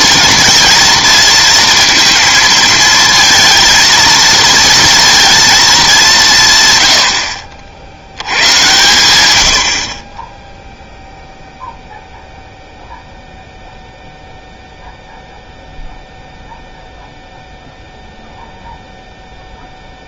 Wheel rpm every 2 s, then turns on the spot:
230, 230, 230, 120, 100, 0, 0, 0, 0, 0.
none